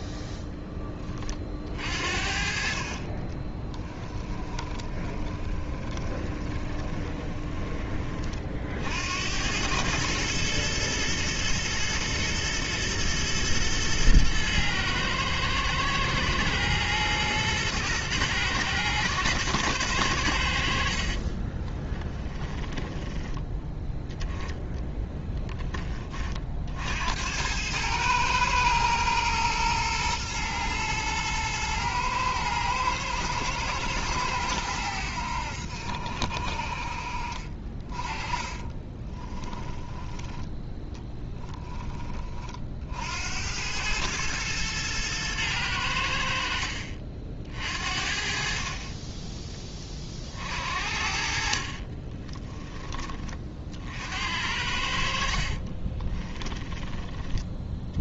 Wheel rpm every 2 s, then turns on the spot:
10, 40, 20, 30, 60, 110, 110, 110, 110, 110, 60, 10, 10, 60, 110, 110, 110, 90, 40, 20, 10, 60, 110, 50, 30, 60, 20, 60, 20.
4-8 22-24 38-40 52-54